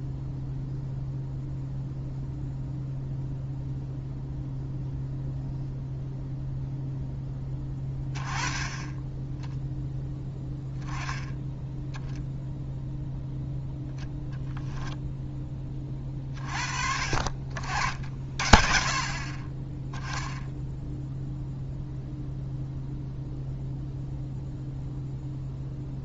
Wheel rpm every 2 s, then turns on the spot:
0, 0, 0, 0, 10, 10, 0, 0, 40, 30, 0, 0, 0.
none